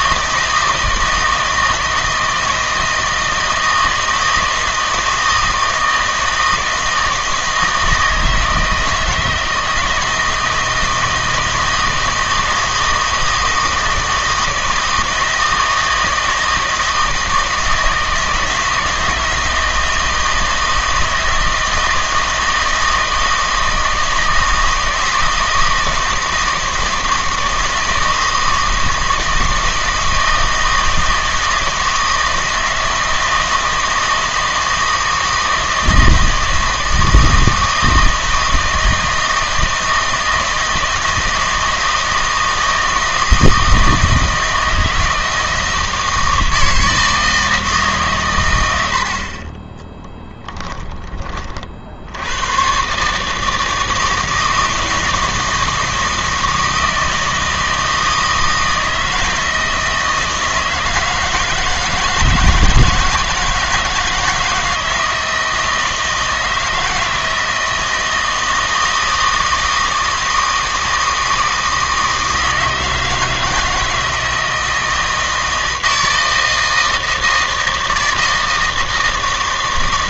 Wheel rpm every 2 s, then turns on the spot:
160, 160, 160, 160, 160, 160, 160, 160, 160, 160, 160, 160, 160, 160, 160, 160, 160, 160, 160, 160, 160, 160, 160, 160, 80, 10, 130, 160, 160, 160, 160, 160, 160, 170, 160, 160, 160, 160, 160, 160.
none